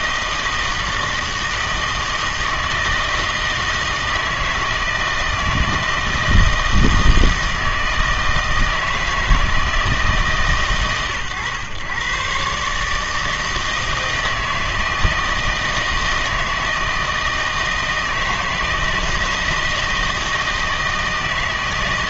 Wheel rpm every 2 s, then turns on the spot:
160, 160, 160, 160, 160, 130, 140, 160, 160, 160, 160.
none